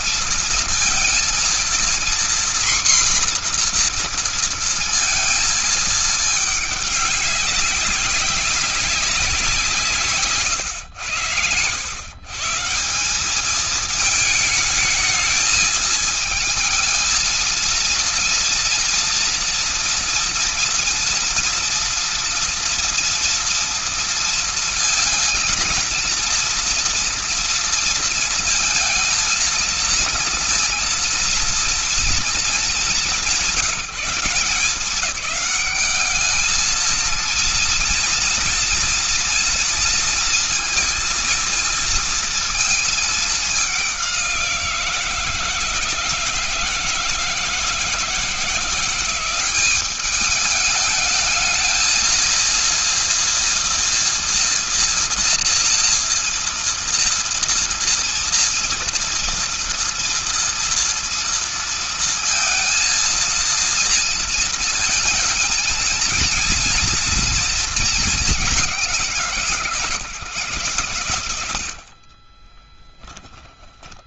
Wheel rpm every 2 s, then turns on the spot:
230, 250, 230, 210, 190, 150, 140, 220, 220, 230, 230, 240, 230, 230, 230, 230, 230, 180, 210, 230, 230, 220, 180, 160, 160, 200, 230, 240, 230, 230, 230, 230, 230, 230, 200, 130, 20.
10-12 72-74